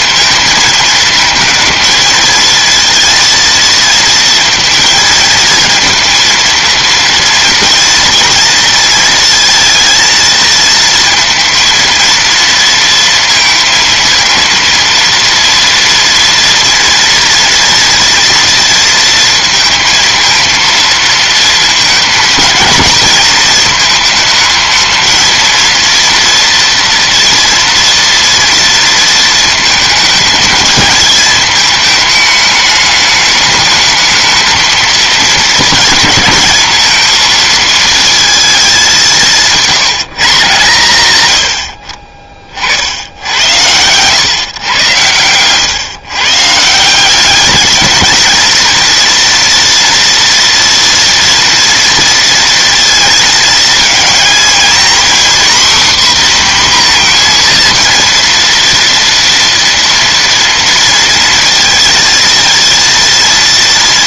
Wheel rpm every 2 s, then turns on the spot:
230, 230, 230, 230, 230, 230, 230, 230, 230, 230, 230, 220, 220, 230, 230, 220, 210, 220, 230, 210, 140, 50, 120, 160, 230, 230, 230, 240, 250, 230, 230, 230.
none